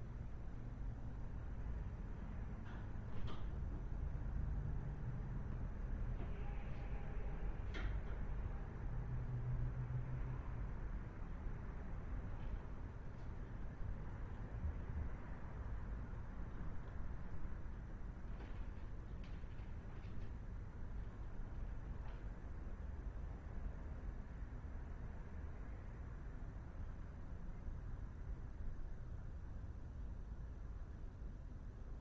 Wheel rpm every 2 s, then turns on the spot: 0, 0, 0, 0, 0, 0, 0, 0, 0, 0, 0, 0, 0, 0, 0, 0.
none